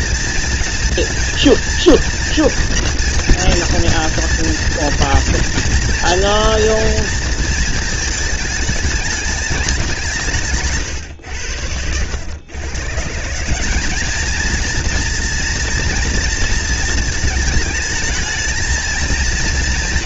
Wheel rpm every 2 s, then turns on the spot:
230, 230, 230, 230, 210, 130, 140, 230, 230, 230.
10-12